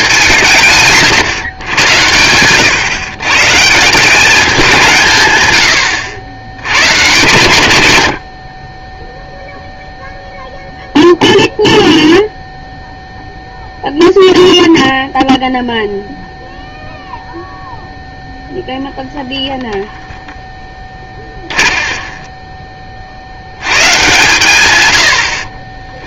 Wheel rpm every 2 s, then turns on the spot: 130, 130, 170, 110, 20, 0, 0, 0, 0, 0, 10, 30, 120.
20-22